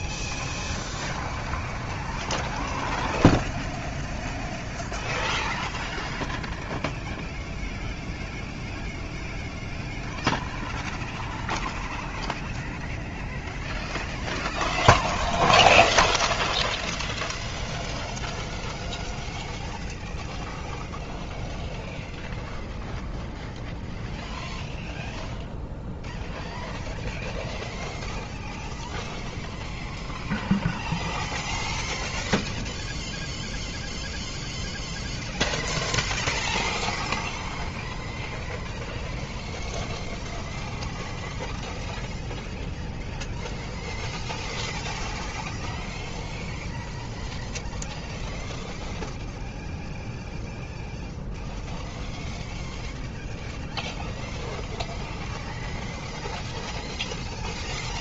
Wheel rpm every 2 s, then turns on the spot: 30, 40, 30, 10, 0, 0, 0, 0, 0, 0, 0, 0, 0, 0, 0, 0, 0, 0, 0, 0, 0, 0, 0, 0, 0, 0, 0, 0, 0.
0-4